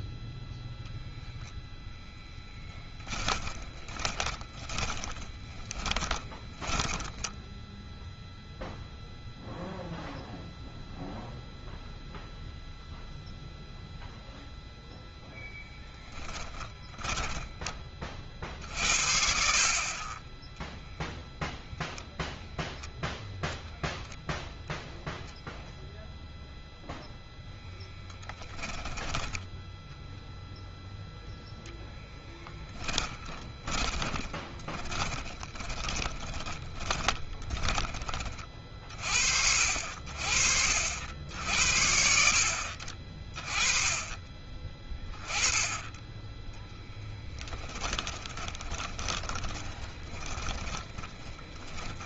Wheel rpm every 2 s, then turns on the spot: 0, 10, 10, 10, 0, 0, 0, 0, 20, 70, 0, 0, 0, 0, 20, 0, 10, 10, 20, 40, 70, 50, 10, 10, 10, 10.
2-6 16-20 32-38 46-52